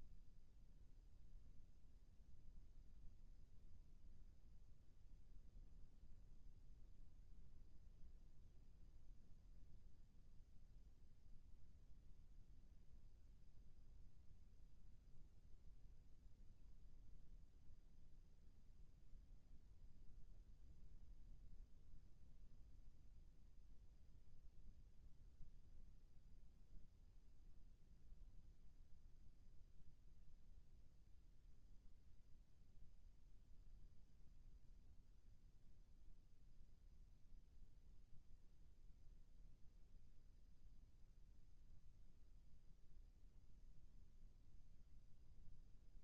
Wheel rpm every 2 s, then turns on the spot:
0, 0, 0, 0, 0, 0, 0, 0, 0, 0, 0, 0, 0, 0, 0, 0, 0, 0, 0, 0, 0, 0, 0.
none